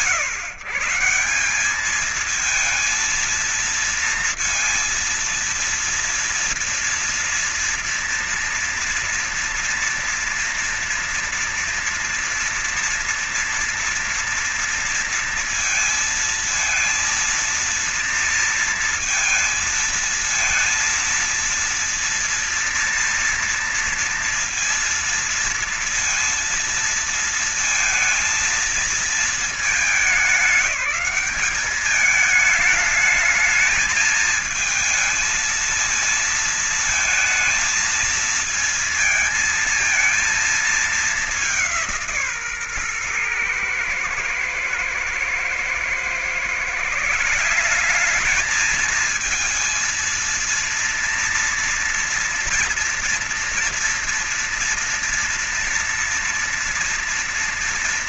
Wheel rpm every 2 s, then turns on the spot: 150, 220, 230, 230, 240, 230, 230, 230, 230, 230, 220, 230, 230, 230, 230, 210, 220, 220, 220, 230, 220, 140, 110, 140, 210, 230, 230, 230, 230.
none